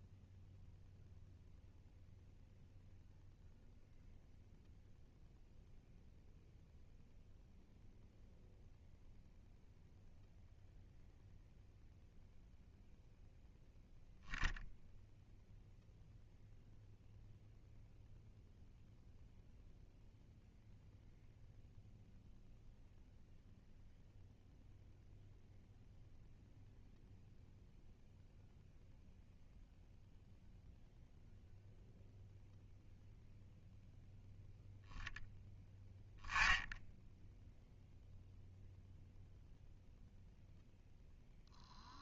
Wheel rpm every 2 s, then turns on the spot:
0, 0, 0, 0, 0, 0, 0, 0, 0, 0, 0, 0, 0, 0, 0, 0, 0, 0, 0, 0, 0.
none